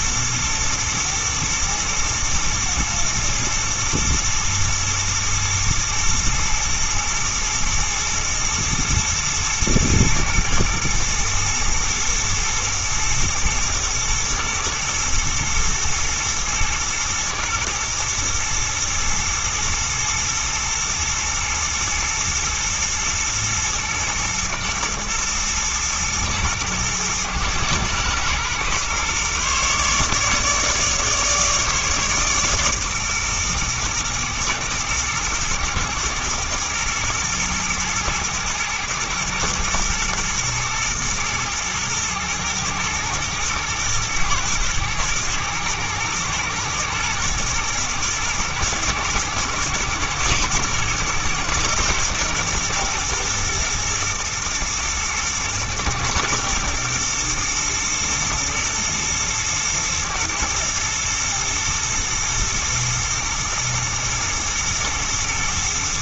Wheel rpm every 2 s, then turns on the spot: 110, 110, 110, 120, 120, 110, 110, 110, 120, 110, 110, 110, 120, 120, 120, 150, 140, 120, 120, 110, 120, 110, 120, 110, 110, 110, 120, 110, 120, 110, 110, 110, 120.
none